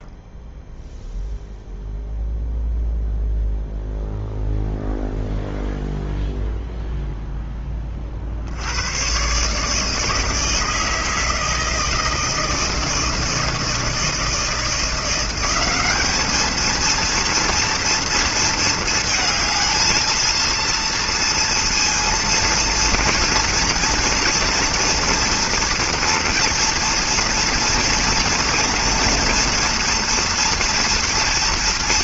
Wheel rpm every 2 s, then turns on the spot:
0, 0, 0, 0, 90, 160, 160, 170, 230, 220, 230, 230, 230, 240, 230, 230.
none